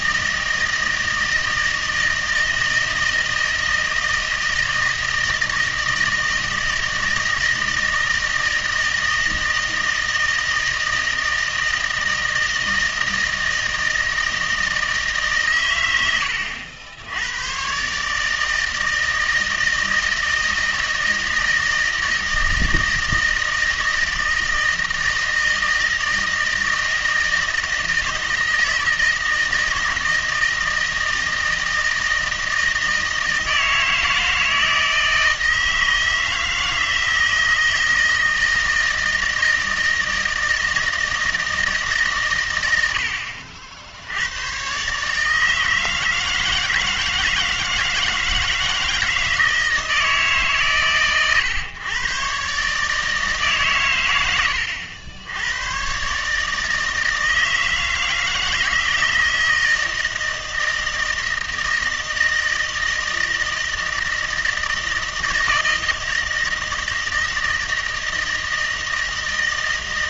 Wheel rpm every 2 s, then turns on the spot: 160, 160, 160, 160, 160, 160, 160, 160, 80, 160, 160, 160, 160, 160, 160, 160, 160, 160, 160, 160, 160, 100, 130, 160, 160, 130, 150, 90, 160, 160, 160, 160, 160, 160, 160.
none